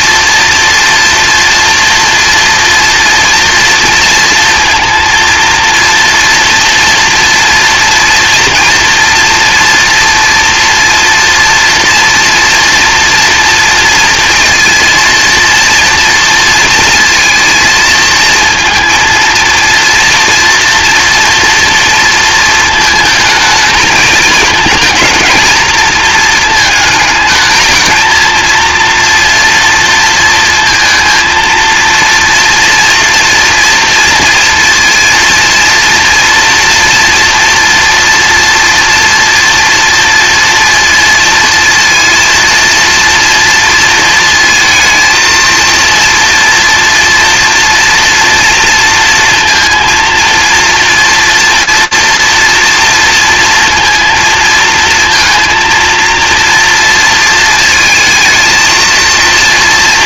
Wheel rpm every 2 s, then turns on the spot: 230, 230, 230, 230, 230, 240, 230, 230, 230, 230, 230, 220, 220, 220, 230, 230, 240, 230, 230, 230, 230, 230, 220, 230, 230, 230, 230, 230, 230, 220.
none